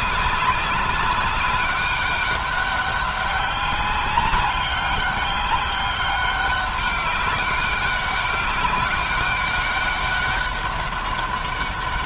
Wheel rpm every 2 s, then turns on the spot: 190, 200, 200, 200, 190, 200.
none